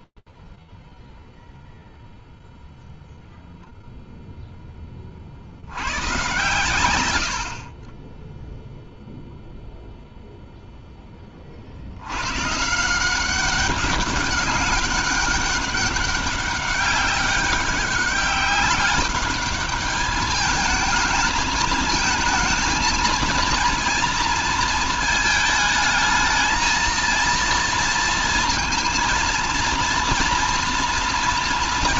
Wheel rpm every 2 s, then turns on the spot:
0, 130, 10, 0, 80, 190, 200, 200, 210, 220, 230, 220, 230, 230, 220, 190.
none